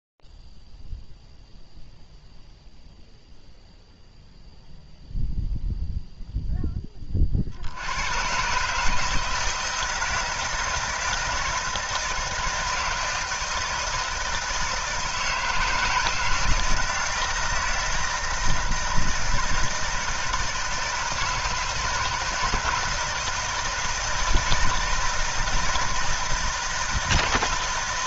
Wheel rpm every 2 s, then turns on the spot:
0, 0, 0, 0, 100, 160, 160, 160, 170, 160, 160, 160, 160, 160.
none